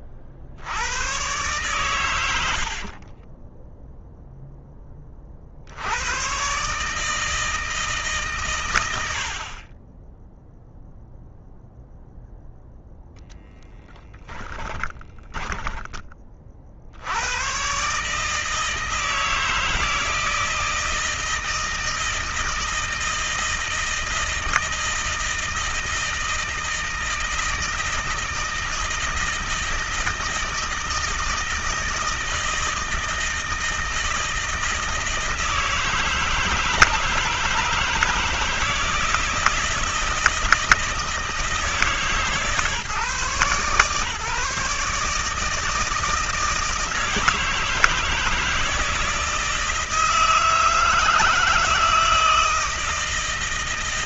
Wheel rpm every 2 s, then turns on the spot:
80, 60, 10, 140, 110, 0, 10, 20, 70, 160, 160, 160, 160, 160, 160, 160, 160, 160, 160, 160, 160, 150, 150, 160, 160, 160, 160.
2-4 14-16